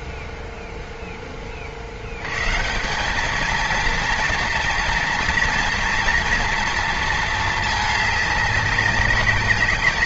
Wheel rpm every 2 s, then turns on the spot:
0, 190, 230, 230, 200.
none